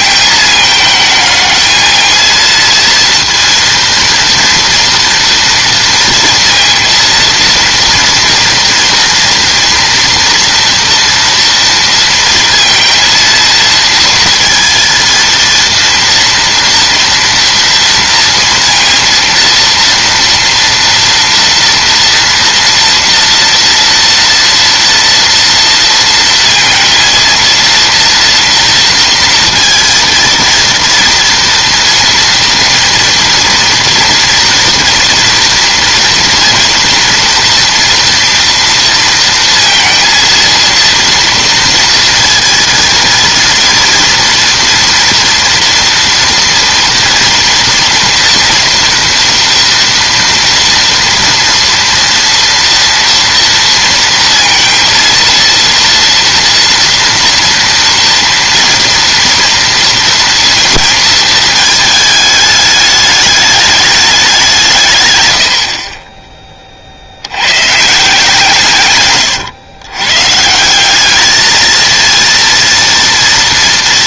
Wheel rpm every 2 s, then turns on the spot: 220, 230, 230, 230, 240, 240, 230, 230, 230, 230, 230, 230, 240, 230, 230, 230, 230, 230, 230, 230, 230, 230, 230, 230, 230, 240, 230, 230, 230, 230, 230, 210, 160, 30, 150, 170, 230.
none